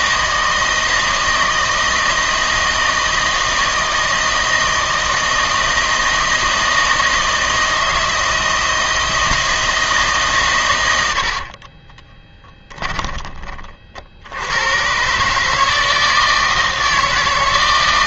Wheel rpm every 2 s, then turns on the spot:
160, 160, 160, 160, 160, 110, 20, 110, 160.
12-14